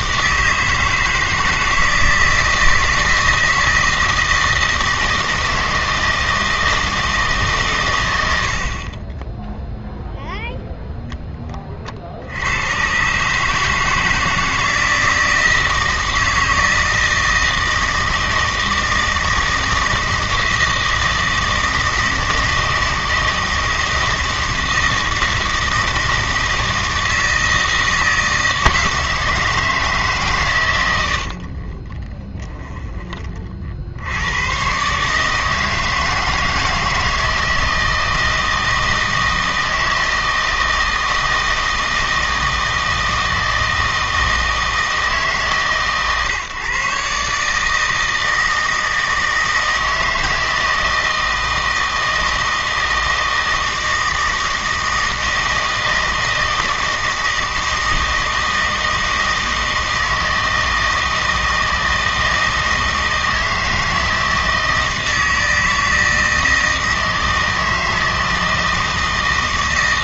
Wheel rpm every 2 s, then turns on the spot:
160, 160, 160, 160, 30, 0, 110, 160, 160, 160, 160, 160, 160, 160, 160, 110, 10, 130, 160, 160, 160, 160, 160, 130, 160, 160, 160, 160, 160, 160, 160, 160, 160, 160, 160.
32-34